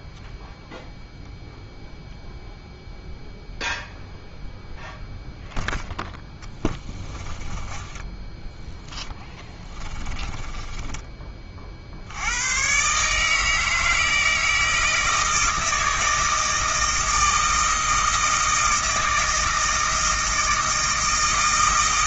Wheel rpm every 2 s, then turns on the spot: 0, 0, 0, 20, 10, 20, 110, 160, 160, 160, 160.
6-8 10-12